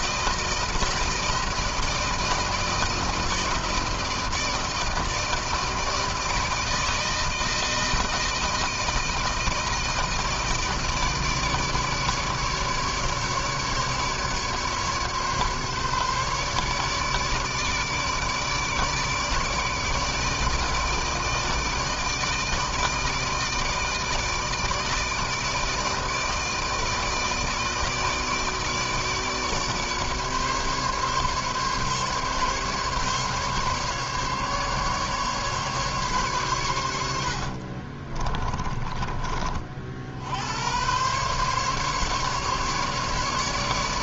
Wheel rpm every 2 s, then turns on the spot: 160, 160, 160, 160, 160, 160, 150, 150, 150, 150, 160, 160, 160, 160, 160, 140, 150, 140, 110, 20, 90, 140.
38-40